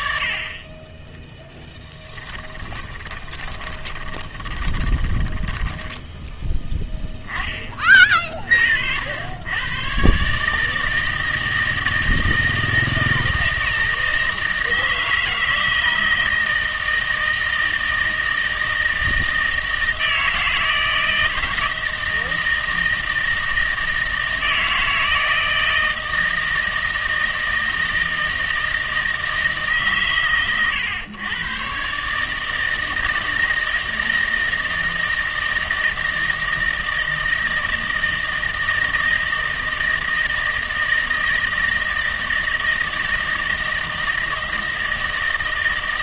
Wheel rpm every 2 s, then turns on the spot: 20, 20, 20, 10, 50, 160, 160, 160, 160, 160, 160, 160, 160, 160, 160, 120, 160, 160, 160, 160, 160, 160, 160.
2-6